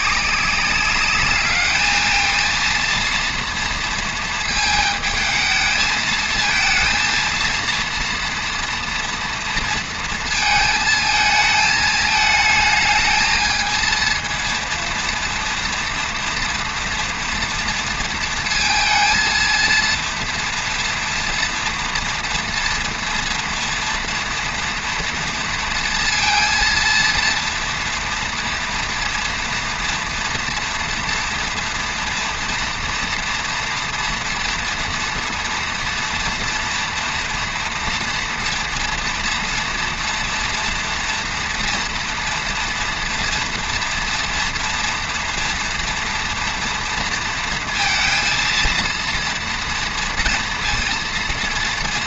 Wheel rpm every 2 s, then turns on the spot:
210, 230, 220, 230, 230, 220, 220, 230, 240, 230, 230, 230, 230, 230, 230, 230, 240, 230, 230, 230, 230, 230, 230, 230, 230, 230.
none